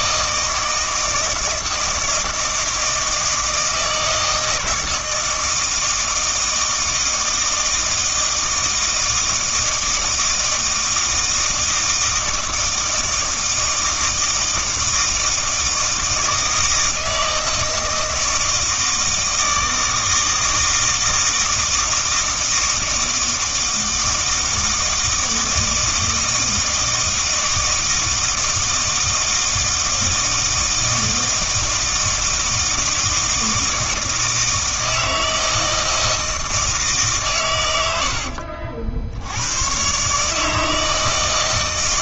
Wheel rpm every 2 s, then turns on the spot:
160, 160, 160, 160, 160, 160, 160, 160, 160, 160, 160, 160, 160, 160, 160, 160, 160, 160, 160, 70, 160.
none